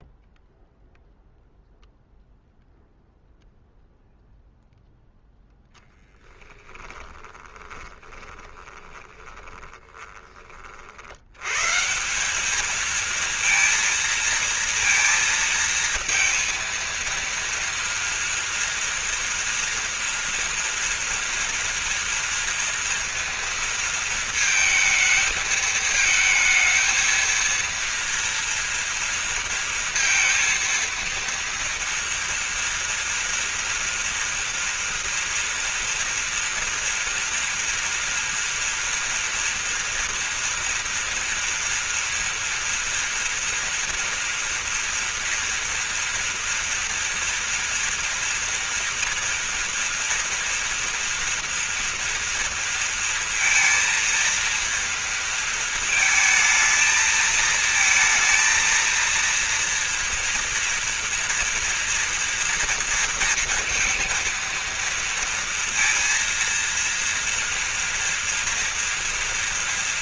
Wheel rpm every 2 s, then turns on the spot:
0, 0, 0, 10, 20, 50, 210, 230, 230, 230, 240, 230, 220, 220, 230, 230, 230, 230, 230, 230, 230, 230, 230, 230, 230, 230, 230, 230, 220, 230, 240, 230, 230, 230, 240.
6-10